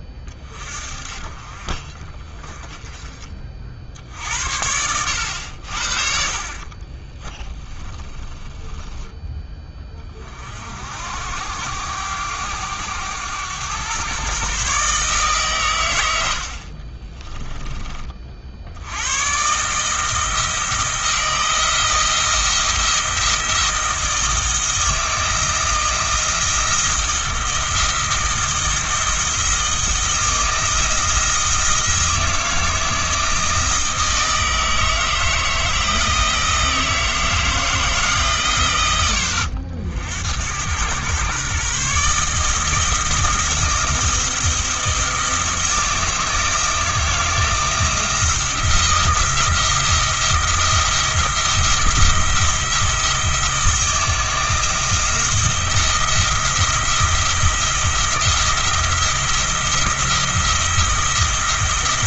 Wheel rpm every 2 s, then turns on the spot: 40, 20, 90, 40, 10, 60, 100, 140, 50, 80, 160, 170, 170, 170, 170, 170, 160, 160, 160, 100, 110, 160, 170, 160, 170, 170, 170, 170, 170, 170, 170.
6-10